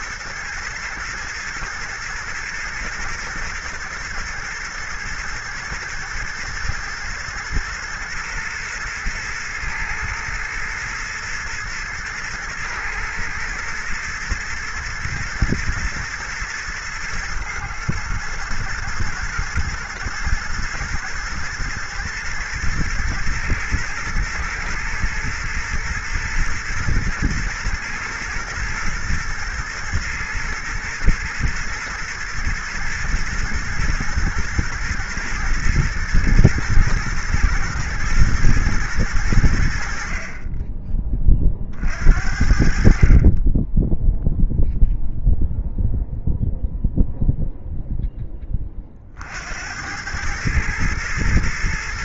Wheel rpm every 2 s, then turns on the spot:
120, 120, 110, 120, 120, 110, 110, 110, 110, 120, 110, 110, 110, 110, 110, 120, 110, 110, 110, 110, 20, 50, 0, 0, 40, 110.
none